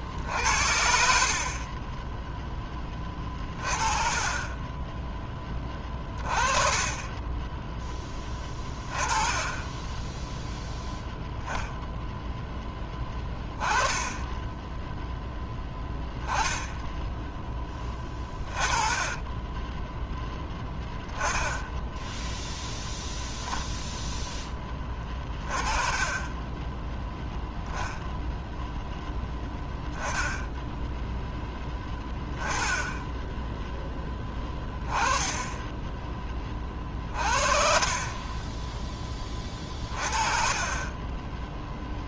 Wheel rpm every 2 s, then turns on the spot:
70, 10, 10, 20, 10, 0, 10, 10, 10, 20, 10, 0, 20, 10, 0, 0, 10, 10, 30, 10, 30.
4-6 8-10 14-22 36-40